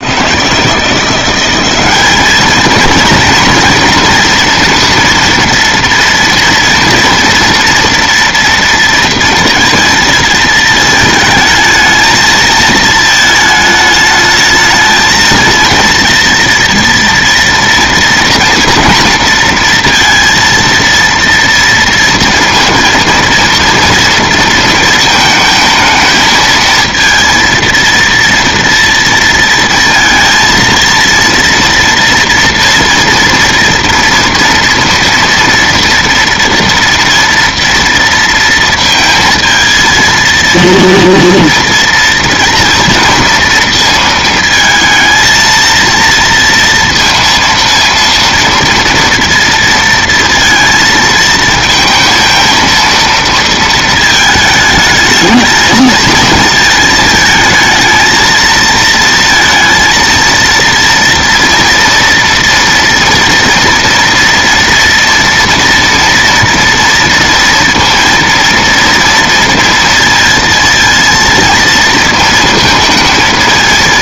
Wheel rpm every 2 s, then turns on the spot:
170, 220, 230, 230, 230, 220, 220, 220, 230, 230, 230, 230, 220, 230, 230, 230, 230, 230, 230, 230, 230, 230, 230, 230, 230, 230, 230, 210, 220, 230, 230, 230, 230, 230, 230, 230, 220.
none